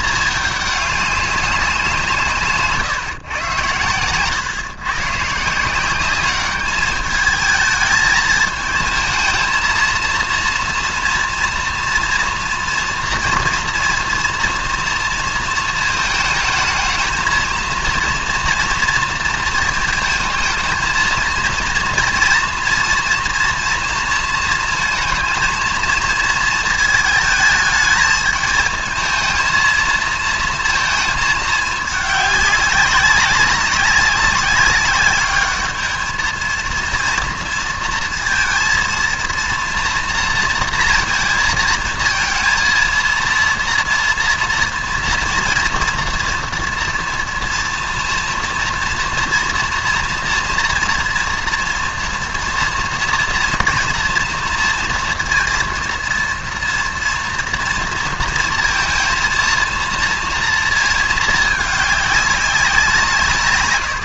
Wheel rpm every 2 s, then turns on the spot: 210, 140, 130, 200, 220, 230, 230, 230, 220, 230, 220, 240, 220, 230, 220, 230, 200, 200, 230, 230, 230, 230, 230, 230, 230, 230, 230, 230, 240, 230, 230, 190.
none